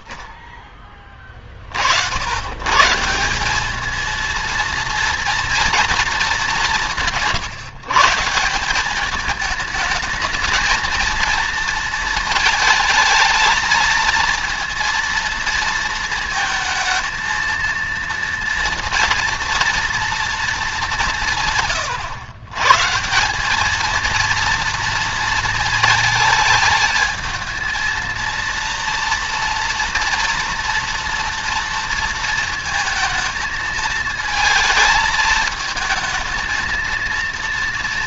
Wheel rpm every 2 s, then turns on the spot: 30, 100, 230, 190, 170, 220, 230, 230, 230, 230, 220, 120, 220, 220, 230, 230, 230, 220, 220.
none